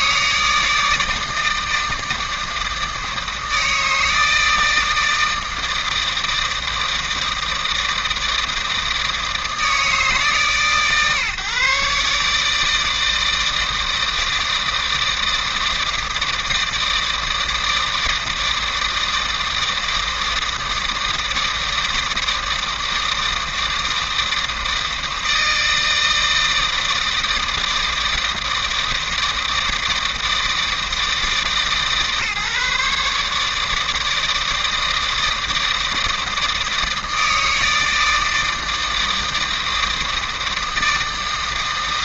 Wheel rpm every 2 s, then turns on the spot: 160, 160, 160, 160, 160, 130, 160, 160, 160, 160, 160, 160, 160, 160, 160, 150, 140, 160, 160, 160, 160.
none